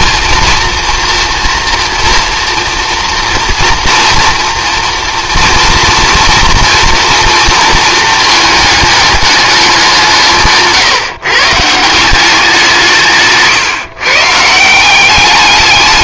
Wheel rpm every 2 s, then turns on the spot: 230, 240, 230, 230, 210, 150, 170, 170.
none